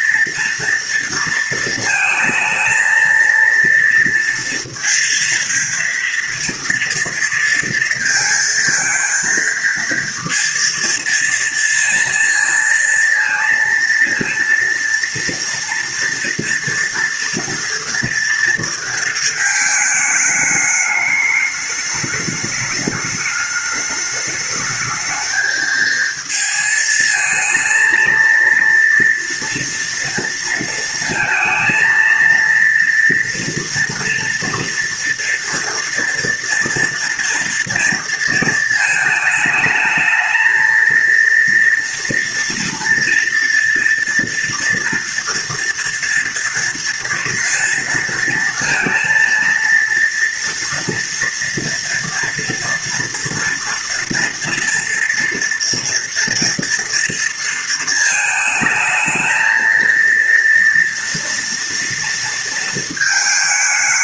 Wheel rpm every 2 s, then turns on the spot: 230, 220, 230, 230, 230, 230, 230, 230, 230, 230, 210, 210, 210, 220, 230, 230, 230, 230, 230, 230, 220, 240, 230, 230, 230, 230, 230, 230, 230, 220, 230, 230.
none